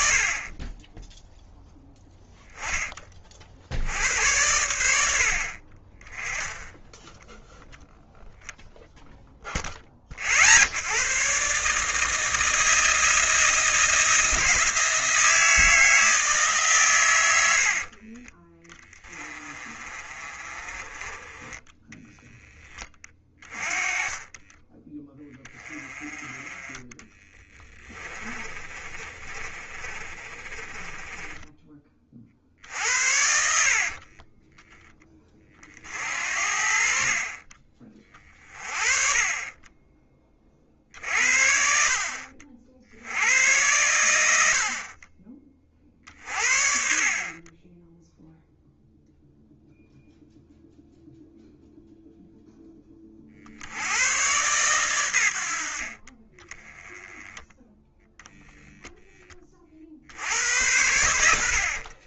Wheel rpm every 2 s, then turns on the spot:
20, 20, 80, 10, 0, 80, 160, 170, 130, 20, 30, 10, 20, 20, 30, 20, 60, 10, 50, 30, 50, 70, 50, 40, 0, 0, 20, 120, 20, 0, 80.
26-32